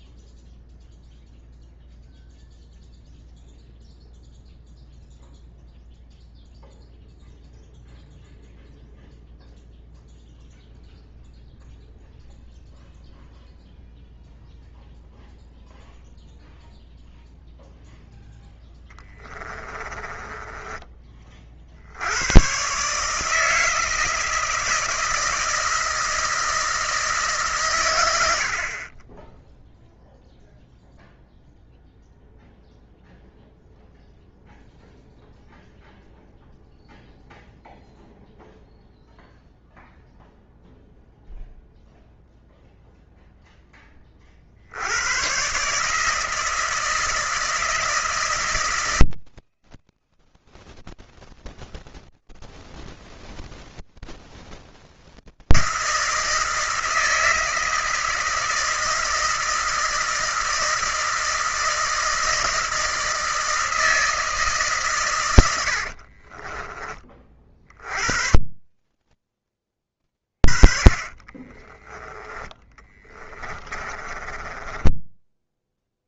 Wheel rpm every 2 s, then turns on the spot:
0, 0, 0, 0, 0, 0, 0, 0, 0, 20, 30, 150, 160, 150, 20, 0, 0, 0, 0, 0, 0, 0, 120, 160, 160, 160, 160, 160, 160, 160, 160, 160, 110, 30, 30, 50, 20, 30.
18-20 70-76